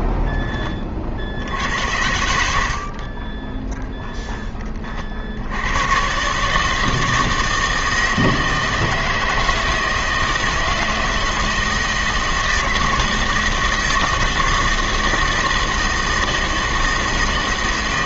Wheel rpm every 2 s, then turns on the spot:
20, 70, 20, 150, 160, 160, 160, 160, 160.
none